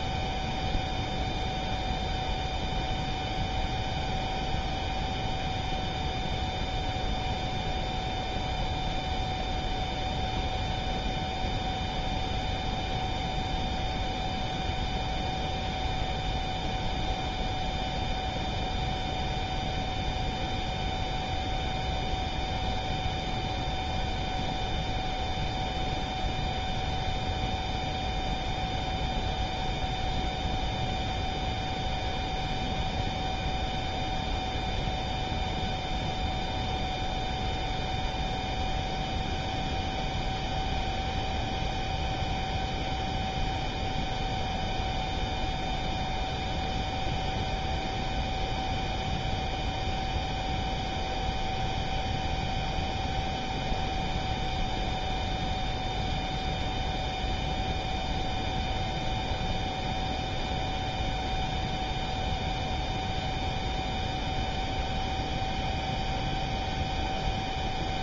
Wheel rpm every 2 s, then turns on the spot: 0, 0, 0, 0, 0, 0, 0, 0, 0, 0, 0, 0, 0, 0, 0, 0, 0, 0, 0, 0, 0, 0, 0, 0, 0, 0, 0, 0, 0, 0, 0, 0, 0, 0.
none